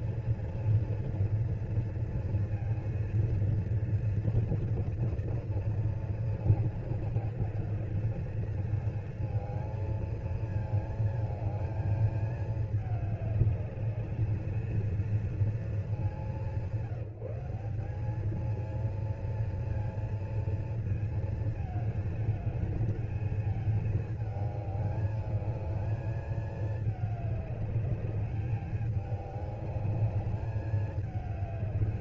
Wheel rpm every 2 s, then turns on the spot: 240, 230, 230, 230, 230, 220, 210, 220, 180, 220, 230, 220, 220, 220, 210, 210.
none